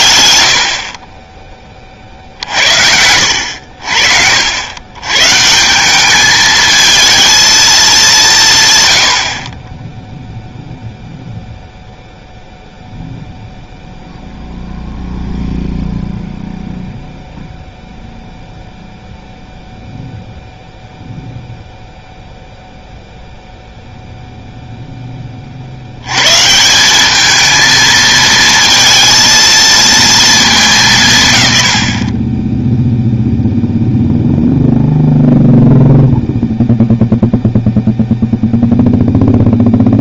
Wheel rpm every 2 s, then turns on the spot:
40, 70, 130, 230, 80, 0, 0, 0, 0, 0, 0, 0, 50, 220, 230, 120, 0, 0, 0, 0.
none